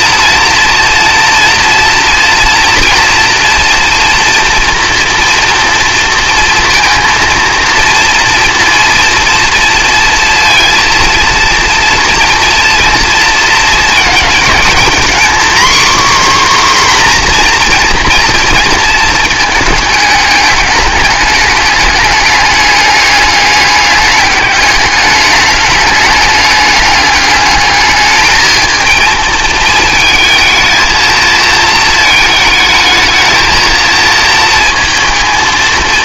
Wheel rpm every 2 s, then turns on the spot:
230, 240, 240, 230, 230, 230, 240, 230, 270, 230, 210, 210, 200, 210, 220, 230, 220, 230.
none